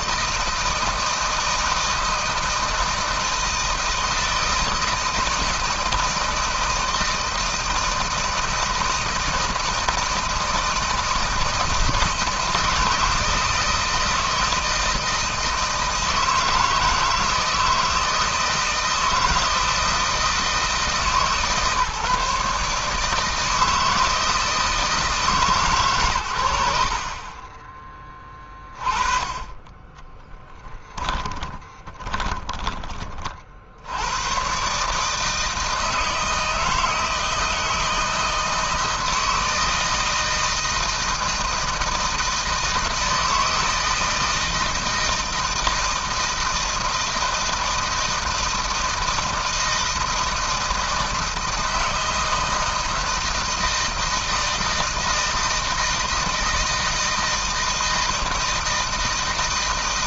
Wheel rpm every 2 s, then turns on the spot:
160, 160, 160, 160, 160, 160, 160, 160, 160, 160, 150, 150, 160, 60, 20, 10, 30, 140, 160, 160, 160, 160, 160, 160, 160, 160, 160, 160, 160, 160.
30-32